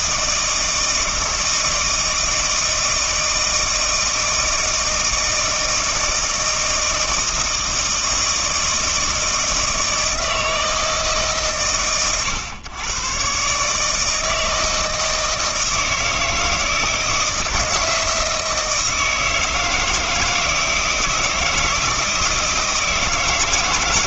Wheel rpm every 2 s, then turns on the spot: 160, 160, 160, 160, 160, 160, 120, 160, 160, 160, 160, 160.
none